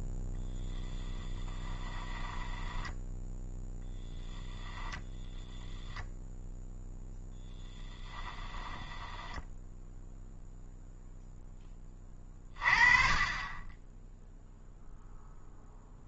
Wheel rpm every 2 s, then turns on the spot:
0, 10, 0, 0, 10, 0, 30, 0.
2-4 8-10